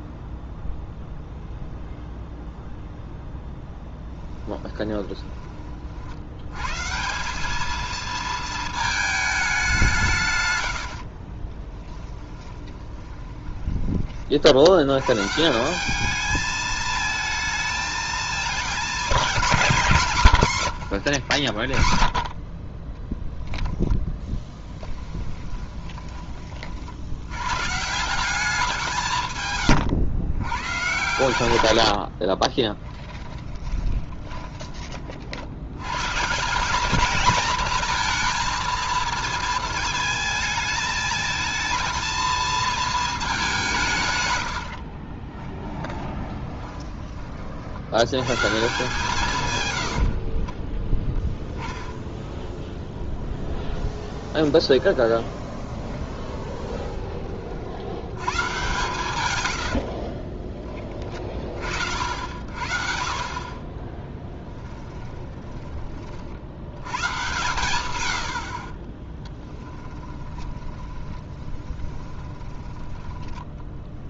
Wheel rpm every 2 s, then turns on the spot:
0, 0, 20, 140, 220, 100, 10, 80, 220, 210, 160, 20, 10, 50, 190, 120, 20, 30, 200, 230, 220, 230, 60, 10, 150, 20, 20, 20, 20, 130, 20, 60, 10, 80, 40, 30, 10.
4-6 12-14 20-22 24-26 32-36 44-48 52-58 64-66 70-72